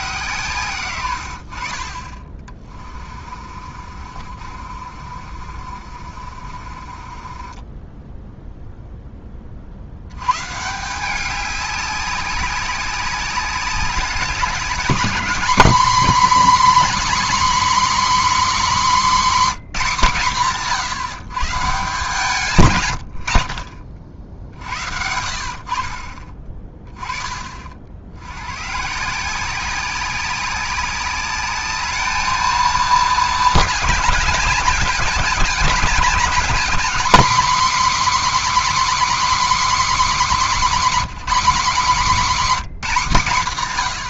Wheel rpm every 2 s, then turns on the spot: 130, 30, 50, 30, 0, 160, 200, 200, 270, 260, 160, 140, 60, 30, 130, 200, 230, 200, 230, 290, 260, 210.
2-8